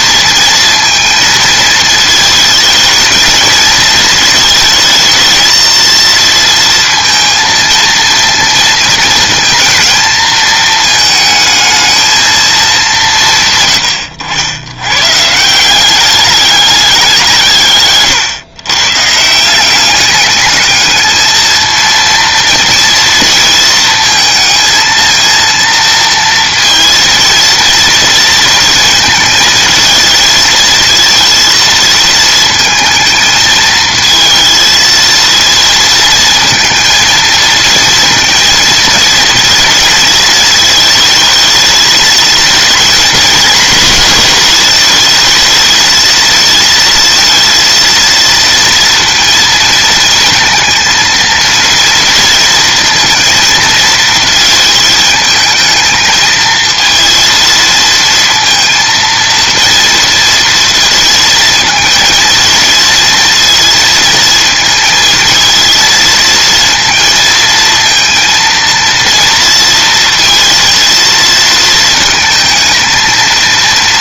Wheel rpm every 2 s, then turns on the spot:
230, 220, 220, 230, 230, 220, 180, 110, 190, 140, 220, 230, 230, 230, 230, 220, 220, 230, 220, 230, 220, 220, 210, 220, 230, 230, 230, 220, 230, 230, 230, 230, 220, 230, 230, 230, 230.
none